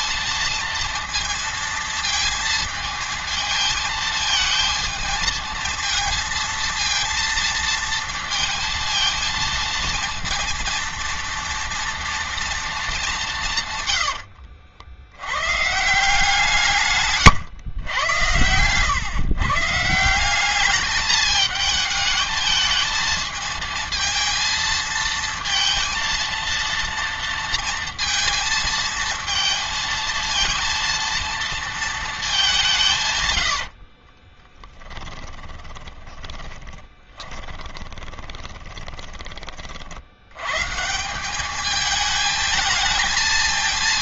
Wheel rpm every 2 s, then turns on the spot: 230, 230, 220, 230, 230, 230, 220, 60, 150, 120, 200, 220, 220, 240, 230, 230, 180, 10, 10, 20, 130, 220.
34-40